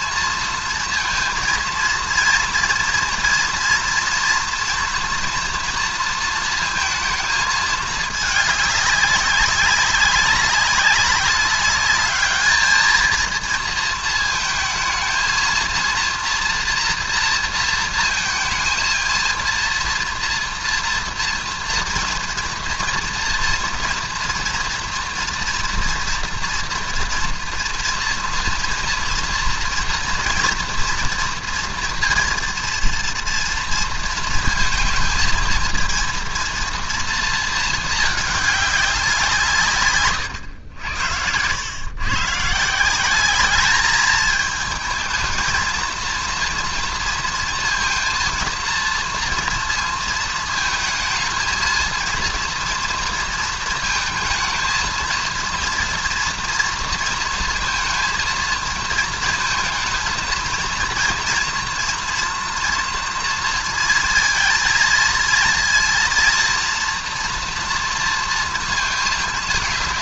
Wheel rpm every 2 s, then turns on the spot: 230, 230, 240, 230, 210, 200, 210, 230, 230, 230, 230, 230, 230, 230, 230, 230, 230, 230, 220, 220, 120, 120, 210, 230, 230, 230, 230, 230, 230, 230, 230, 230, 230, 230, 230.
none